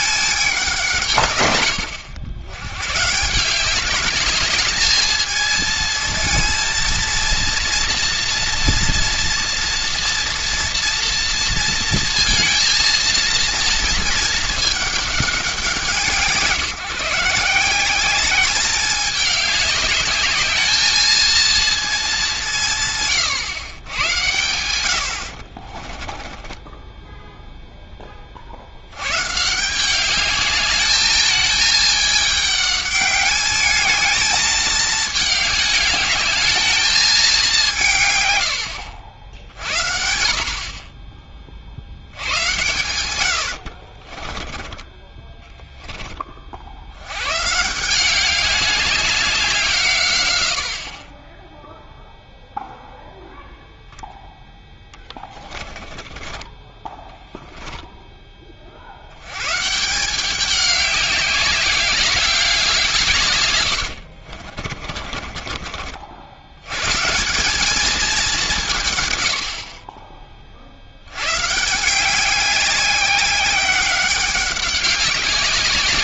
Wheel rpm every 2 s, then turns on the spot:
180, 100, 210, 230, 230, 240, 230, 210, 170, 200, 220, 160, 90, 10, 70, 210, 210, 220, 220, 90, 50, 110, 20, 70, 200, 80, 0, 10, 20, 40, 200, 180, 40, 100, 180, 60, 190, 190.
26-28 44-46 54-56 64-66